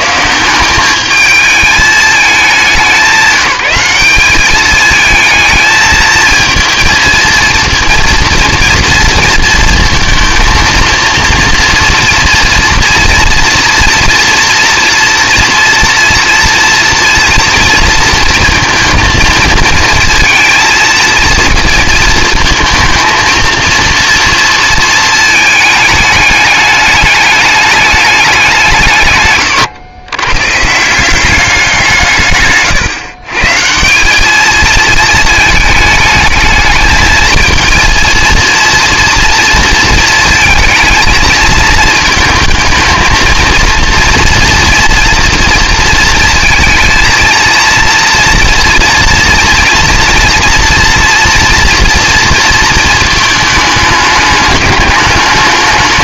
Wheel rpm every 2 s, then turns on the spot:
180, 200, 210, 230, 230, 230, 230, 230, 230, 230, 230, 220, 230, 210, 180, 140, 130, 220, 220, 230, 220, 230, 230, 230, 230, 230, 230, 210.
none